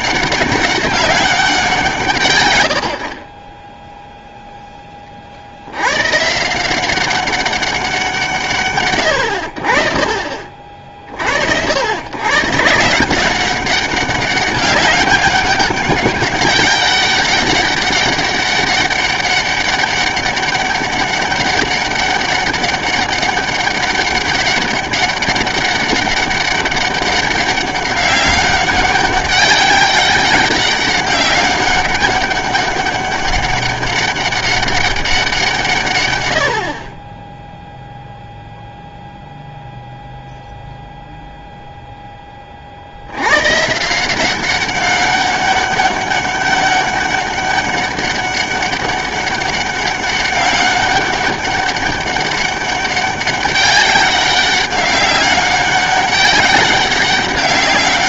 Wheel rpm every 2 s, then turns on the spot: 200, 90, 10, 180, 140, 50, 150, 200, 200, 200, 200, 190, 190, 200, 200, 200, 200, 200, 50, 0, 0, 40, 190, 200, 200, 200, 200, 190, 200.
none